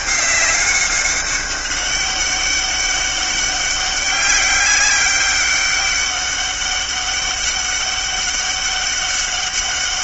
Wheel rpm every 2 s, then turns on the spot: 200, 190, 200, 200, 200.
none